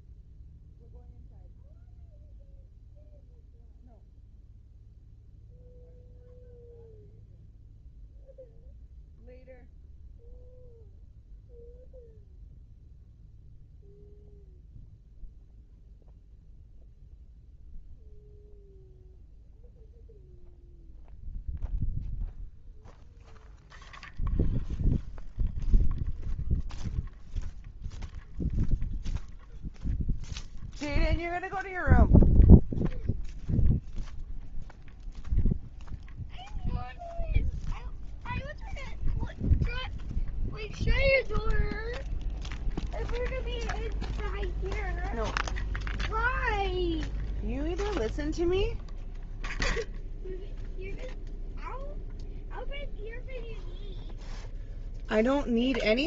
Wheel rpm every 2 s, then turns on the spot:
0, 0, 0, 0, 0, 0, 0, 0, 0, 0, 0, 0, 0, 0, 0, 0, 0, 0, 0, 0, 0, 0, 0, 0, 0, 0, 0, 0.
none